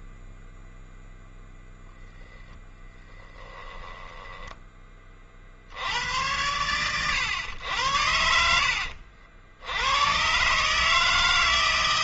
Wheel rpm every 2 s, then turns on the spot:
0, 0, 10, 80, 90, 130.
4-6